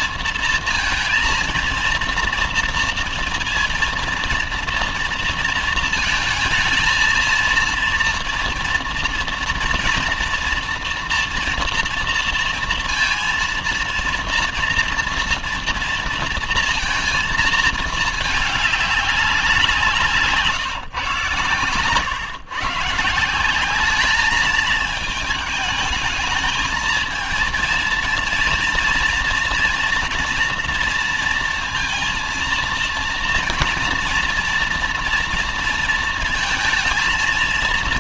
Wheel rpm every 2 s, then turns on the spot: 230, 230, 230, 220, 230, 240, 230, 230, 230, 210, 150, 150, 220, 220, 230, 230, 230, 230, 230.
none